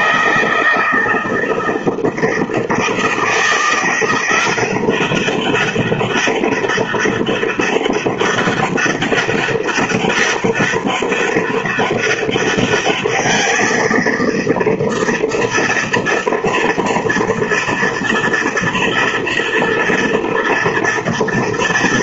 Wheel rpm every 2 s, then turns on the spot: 160, 160, 180, 200, 200, 200, 200, 230, 230, 230, 230.
none